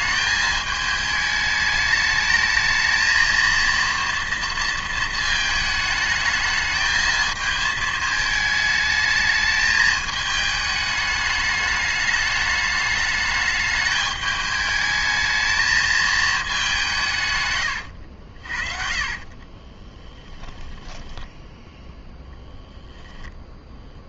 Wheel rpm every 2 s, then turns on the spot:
210, 220, 230, 220, 220, 210, 210, 210, 170, 30, 10, 0.
18-22